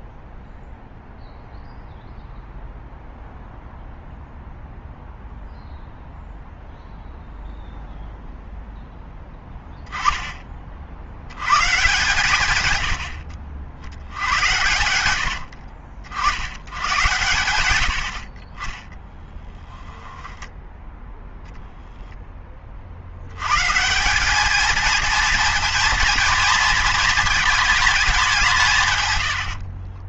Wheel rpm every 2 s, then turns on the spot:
0, 0, 0, 0, 0, 30, 120, 100, 100, 30, 10, 30, 220, 230, 170.
18-22